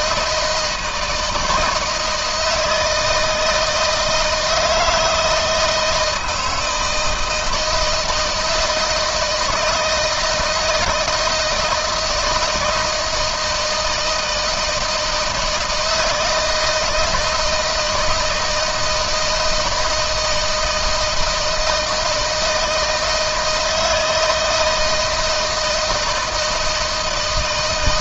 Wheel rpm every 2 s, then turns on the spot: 160, 160, 160, 160, 160, 160, 160, 160, 160, 160, 160, 160, 170, 160.
none